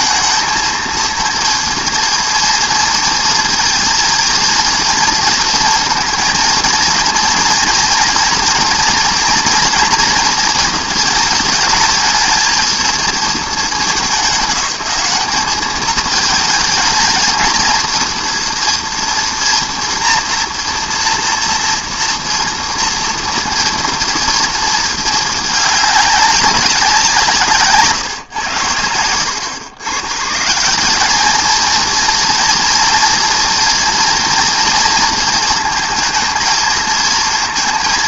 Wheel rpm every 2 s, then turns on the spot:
230, 230, 230, 230, 240, 230, 220, 190, 220, 230, 240, 230, 230, 190, 100, 160, 230, 230, 230.
none